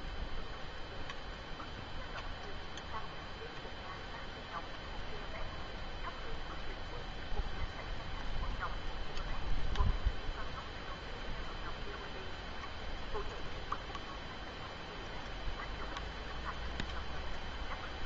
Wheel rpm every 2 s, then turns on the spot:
0, 0, 0, 0, 0, 0, 0, 0, 0.
none